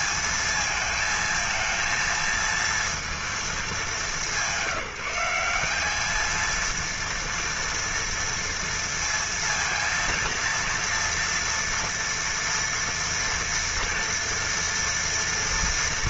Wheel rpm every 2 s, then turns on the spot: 230, 230, 190, 220, 230, 230, 230, 230.
none